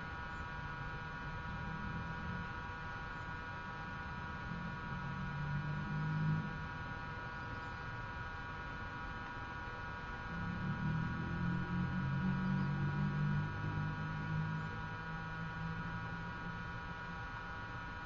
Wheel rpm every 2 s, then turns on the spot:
0, 0, 0, 0, 0, 0, 0, 0, 0.
none